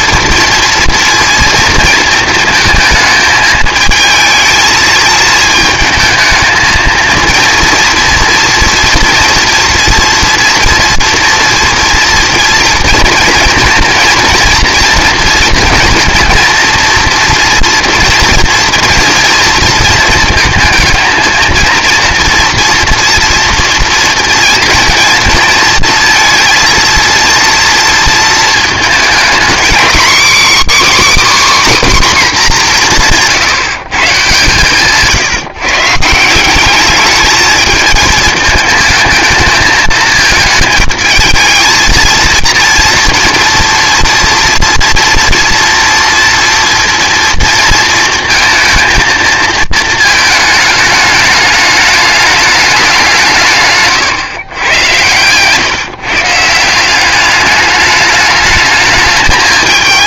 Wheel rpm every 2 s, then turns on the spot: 230, 220, 220, 230, 240, 230, 230, 230, 230, 230, 230, 230, 230, 230, 230, 290, 210, 140, 200, 220, 220, 230, 230, 240, 230, 210, 200, 110, 170, 210.
34-36